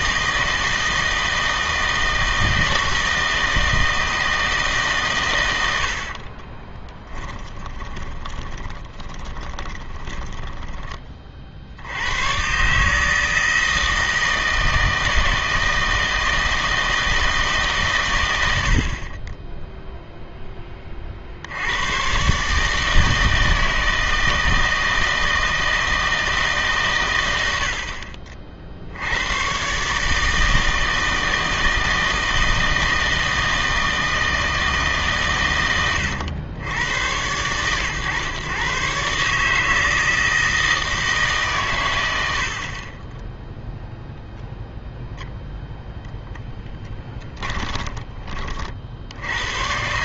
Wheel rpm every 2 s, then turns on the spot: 160, 160, 150, 20, 20, 10, 130, 160, 160, 80, 20, 150, 160, 150, 50, 160, 160, 160, 100, 130, 160, 60, 0, 10, 40.
6-12